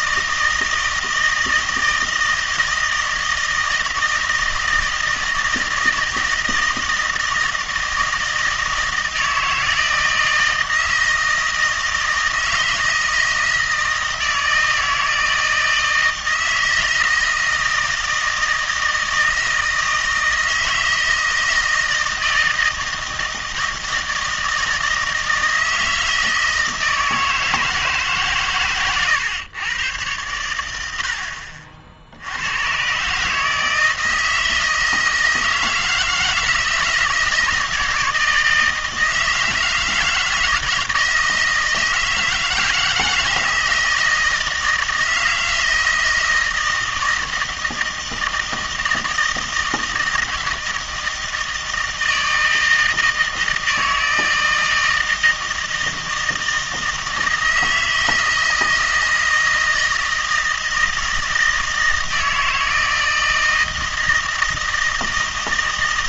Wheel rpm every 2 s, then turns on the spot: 160, 160, 160, 160, 160, 160, 160, 160, 160, 160, 160, 160, 160, 160, 130, 90, 100, 160, 160, 160, 160, 160, 160, 160, 160, 160, 160, 160, 160, 160, 160, 160, 160.
none